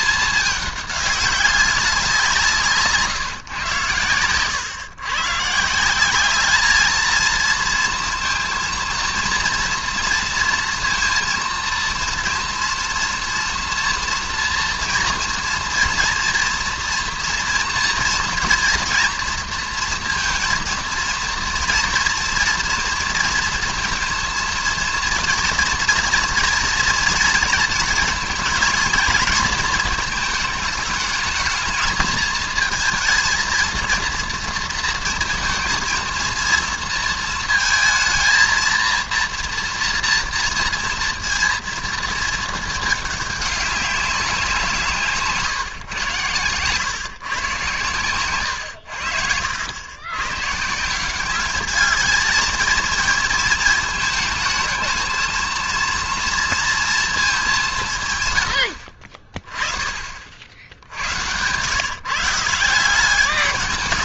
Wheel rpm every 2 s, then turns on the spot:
210, 150, 120, 210, 230, 230, 230, 230, 230, 230, 230, 230, 230, 230, 220, 220, 220, 230, 230, 230, 230, 220, 160, 110, 100, 150, 230, 220, 230, 80, 70, 180.
48-50